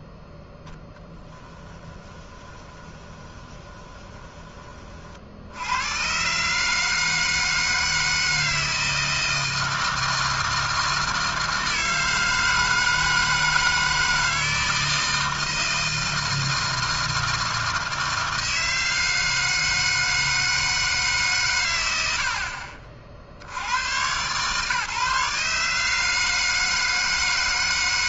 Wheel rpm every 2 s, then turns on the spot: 10, 20, 30, 150, 160, 160, 160, 160, 160, 160, 160, 40, 150, 160.
2-4